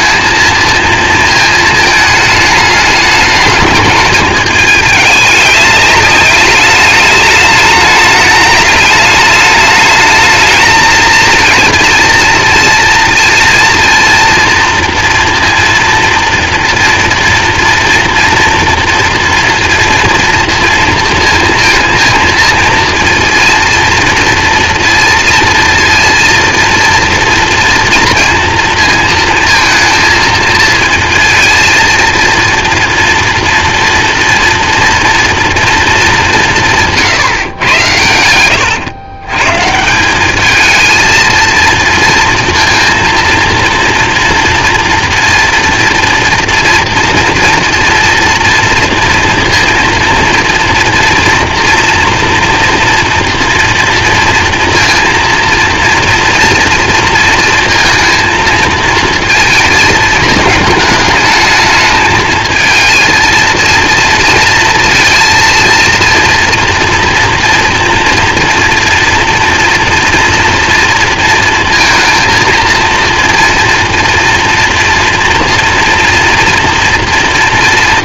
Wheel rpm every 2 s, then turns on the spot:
230, 210, 210, 210, 210, 220, 230, 230, 230, 230, 230, 230, 230, 230, 230, 230, 230, 240, 160, 110, 220, 230, 230, 230, 230, 230, 230, 230, 230, 230, 220, 220, 230, 230, 240, 240, 230, 240, 230.
none